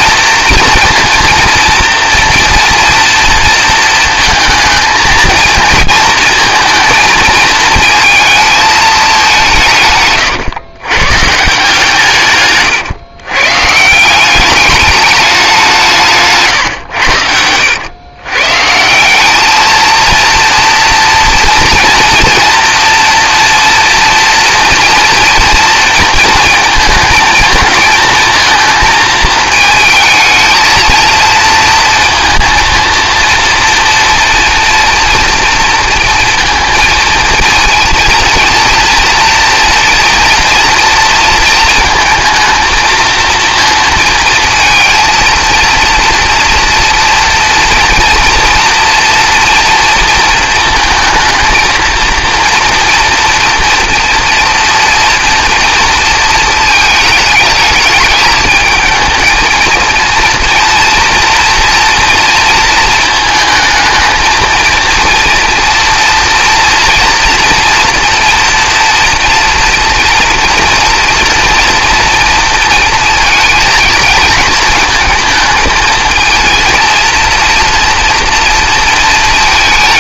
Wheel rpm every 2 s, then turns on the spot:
230, 240, 220, 230, 220, 120, 140, 200, 130, 140, 230, 230, 230, 230, 220, 230, 230, 230, 230, 230, 230, 230, 230, 240, 240, 230, 240, 230, 220, 220, 230, 230, 230, 240, 230, 240, 230, 230, 230, 230.
none